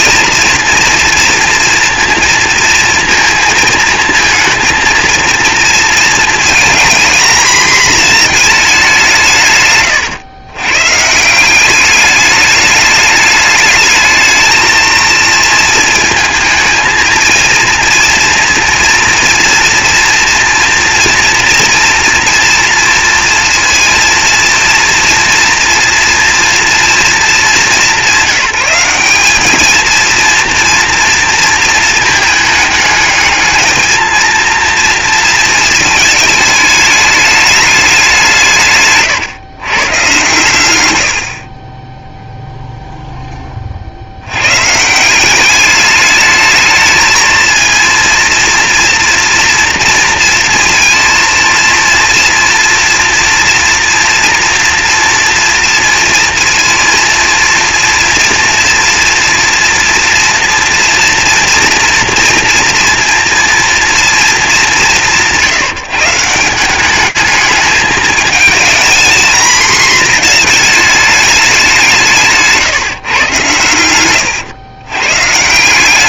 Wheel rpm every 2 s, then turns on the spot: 230, 230, 230, 230, 210, 120, 210, 220, 220, 230, 230, 230, 230, 230, 190, 230, 210, 230, 220, 150, 120, 0, 130, 220, 230, 230, 230, 230, 230, 230, 230, 230, 200, 190, 230, 220, 140, 110.
none